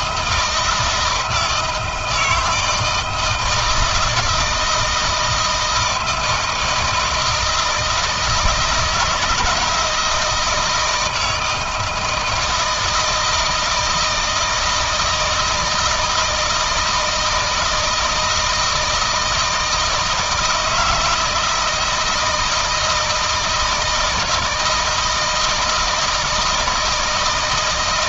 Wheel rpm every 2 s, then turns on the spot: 160, 160, 160, 160, 160, 170, 160, 160, 160, 160, 160, 160, 160, 160.
none